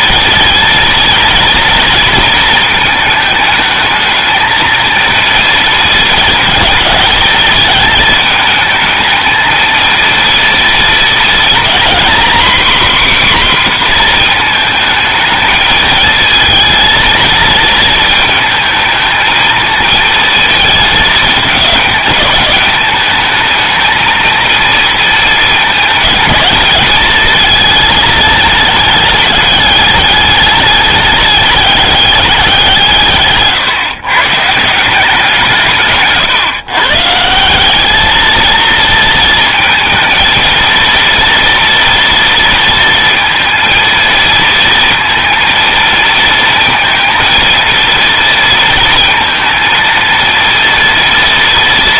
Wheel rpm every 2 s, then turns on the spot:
230, 220, 230, 220, 220, 220, 260, 230, 230, 220, 220, 210, 230, 210, 210, 210, 170, 160, 140, 230, 230, 230, 230, 230, 220, 230.
none